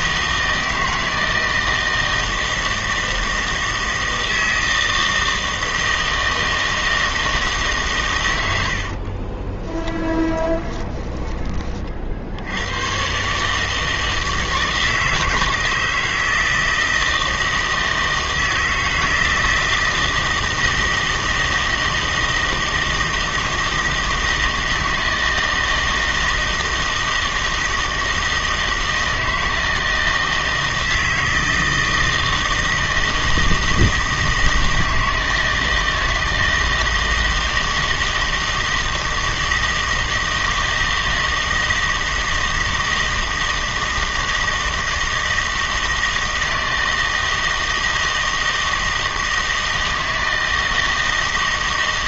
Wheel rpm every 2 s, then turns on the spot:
160, 160, 160, 160, 80, 20, 90, 160, 160, 160, 160, 160, 160, 160, 160, 160, 160, 160, 160, 160, 160, 160, 160, 160, 160, 160.
8-12